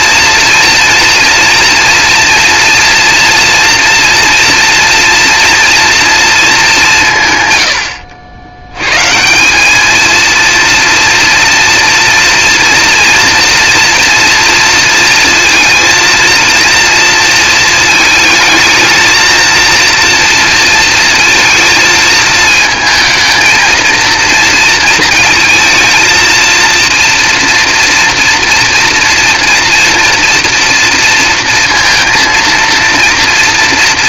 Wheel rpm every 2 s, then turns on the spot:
230, 230, 230, 210, 100, 230, 240, 230, 230, 220, 230, 220, 230, 230, 230, 230, 230.
none